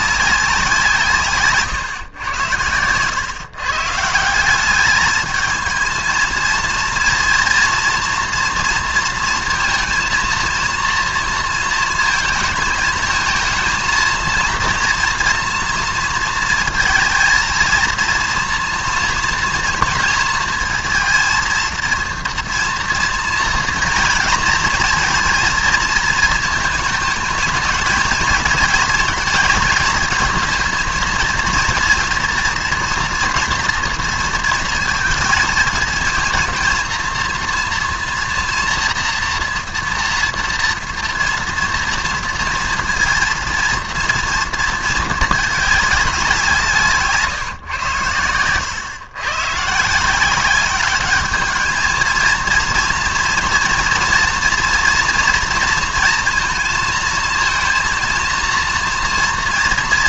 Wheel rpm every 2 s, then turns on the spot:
160, 110, 200, 230, 230, 230, 220, 230, 220, 230, 230, 230, 230, 220, 220, 230, 240, 230, 230, 230, 230, 230, 220, 160, 110, 200, 230, 230, 230, 230.
none